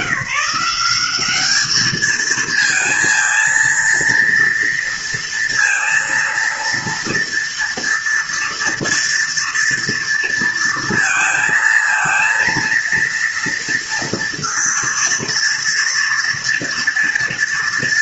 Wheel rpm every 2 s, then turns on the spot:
190, 220, 230, 230, 230, 230, 230, 230, 230.
none